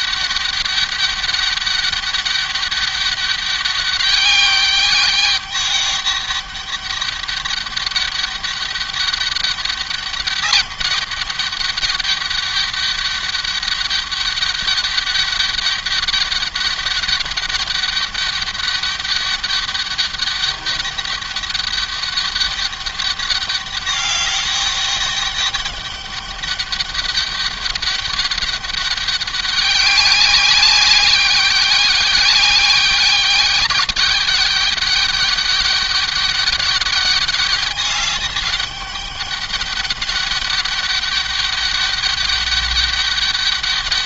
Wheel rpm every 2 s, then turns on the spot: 200, 200, 200, 200, 200, 210, 200, 200, 200, 200, 200, 200, 200, 200, 200, 200, 200, 200, 200, 200, 200, 200.
none